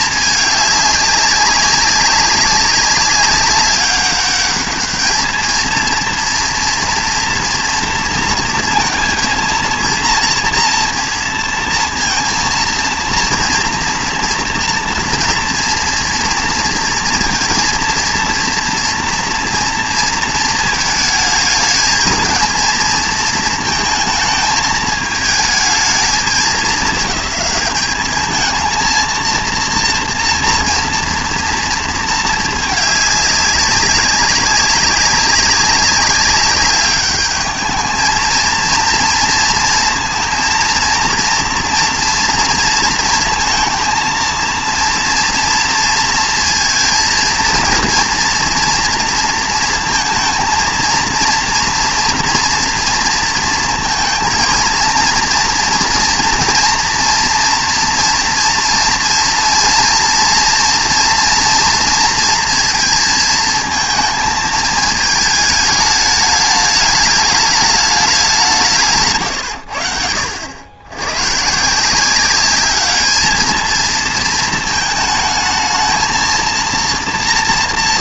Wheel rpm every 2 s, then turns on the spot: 210, 200, 210, 230, 230, 230, 230, 230, 230, 230, 220, 230, 220, 210, 220, 230, 210, 200, 200, 230, 230, 230, 230, 230, 230, 230, 230, 230, 230, 230, 230, 230, 220, 210, 170, 90, 200, 220, 230.
none